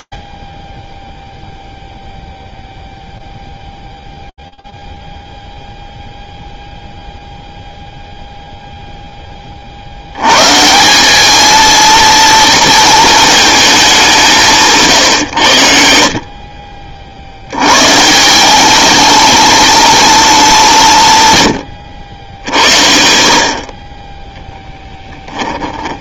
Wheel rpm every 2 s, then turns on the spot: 20, 0, 0, 0, 10, 190, 220, 140, 70, 220, 130, 60, 10.
24-26